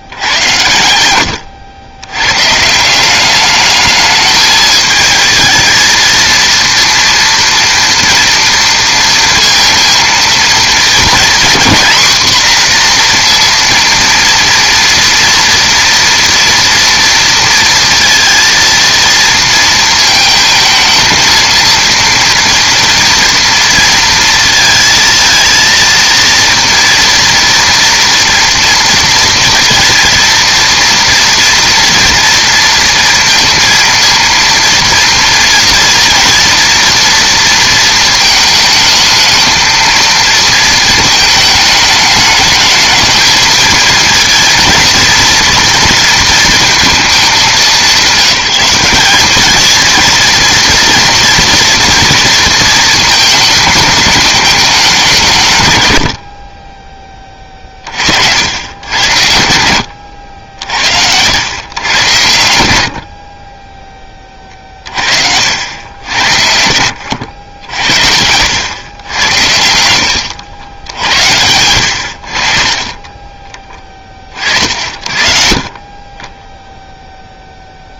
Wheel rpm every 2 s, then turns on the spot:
100, 150, 220, 230, 230, 230, 240, 230, 230, 230, 230, 230, 230, 230, 230, 230, 230, 230, 230, 220, 230, 220, 230, 230, 180, 230, 230, 210, 30, 80, 60, 80, 40, 70, 100, 80, 30, 50, 0.
none